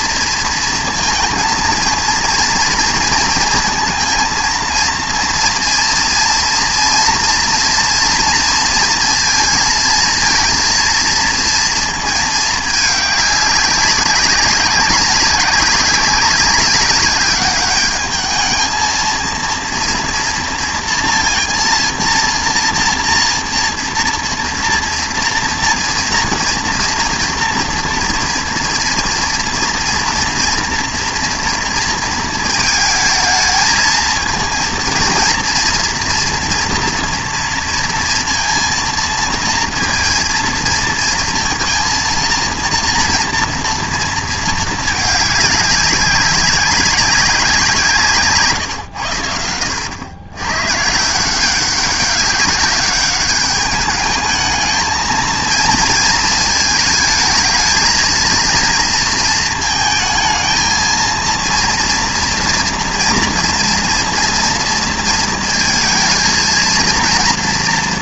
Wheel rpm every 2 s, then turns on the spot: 230, 230, 230, 230, 230, 230, 210, 190, 200, 220, 230, 230, 230, 230, 230, 240, 220, 230, 230, 230, 230, 230, 220, 200, 140, 120, 200, 220, 220, 230, 220, 230, 230, 230.
none